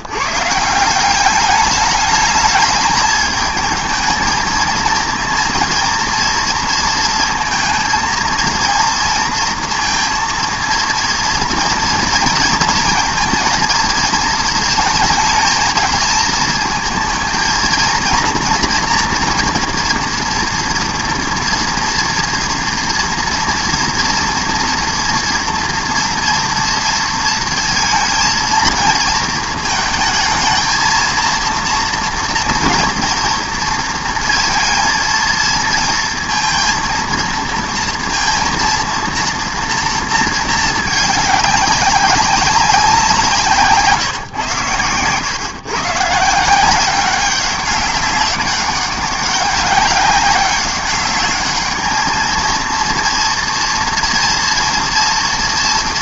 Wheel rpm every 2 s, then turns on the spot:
150, 210, 220, 230, 230, 230, 230, 220, 230, 230, 230, 230, 230, 230, 230, 220, 230, 230, 230, 230, 220, 190, 110, 170, 200, 200, 230, 230.
none